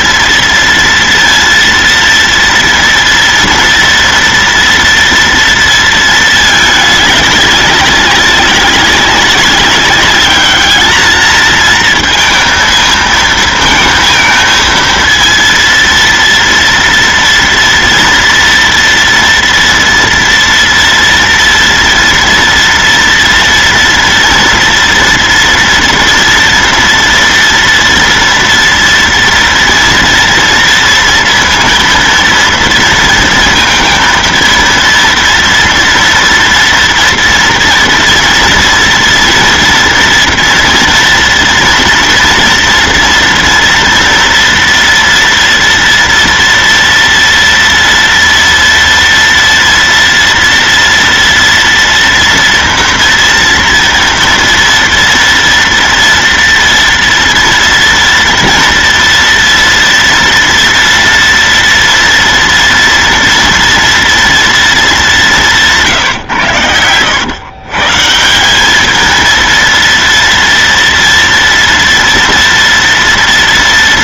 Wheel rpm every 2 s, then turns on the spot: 230, 230, 230, 210, 200, 220, 220, 230, 230, 230, 240, 230, 230, 230, 230, 230, 230, 230, 230, 230, 230, 230, 230, 230, 230, 230, 230, 240, 230, 230, 230, 230, 210, 110, 220, 230, 230.
none